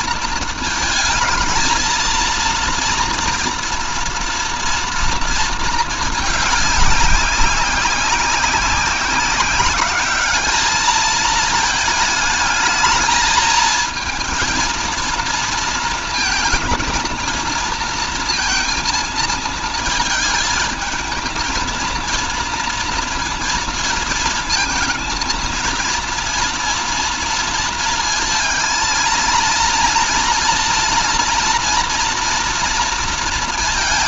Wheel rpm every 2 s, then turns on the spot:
220, 230, 230, 210, 190, 210, 220, 230, 220, 230, 220, 230, 220, 230, 230, 240, 230.
none